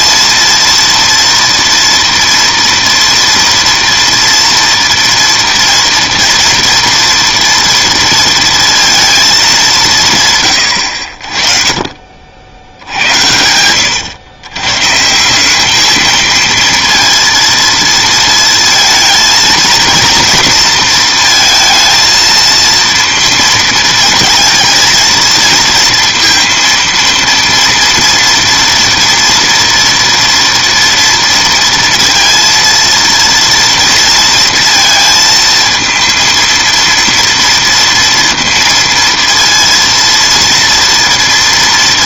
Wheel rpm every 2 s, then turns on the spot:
230, 230, 230, 230, 230, 120, 80, 130, 230, 230, 230, 230, 230, 230, 230, 230, 230, 230, 230, 230, 230.
none